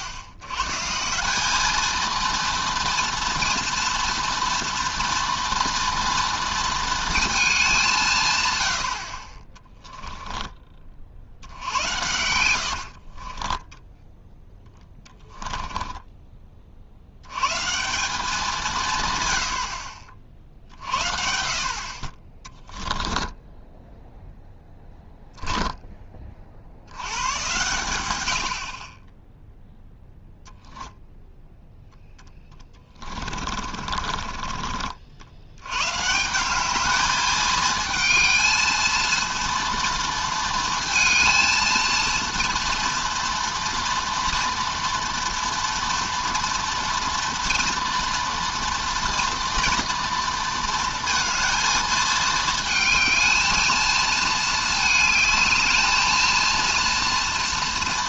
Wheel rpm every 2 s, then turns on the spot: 110, 230, 230, 230, 100, 30, 80, 10, 40, 170, 60, 20, 0, 40, 70, 0, 20, 40, 190, 220, 230, 230, 230, 240, 230, 230, 220, 220, 230.
12-16 22-24 32-36